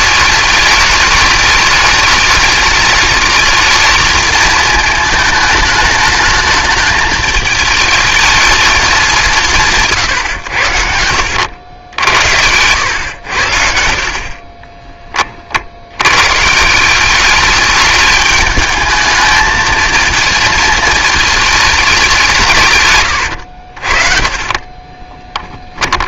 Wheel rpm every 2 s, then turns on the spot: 210, 210, 220, 210, 210, 90, 100, 20, 180, 210, 220, 130, 30.
10-12 14-16 22-26